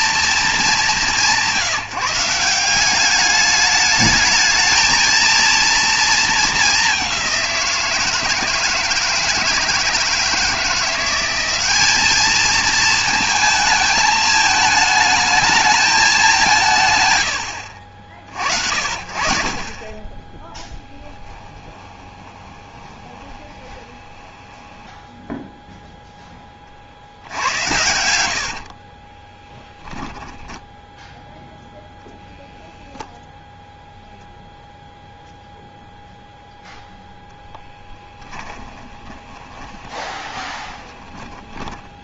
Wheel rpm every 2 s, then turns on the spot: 200, 200, 230, 200, 160, 180, 220, 220, 130, 60, 10, 20, 10, 30, 70, 10, 0, 0, 0, 20, 20.
20-26 28-32 38-42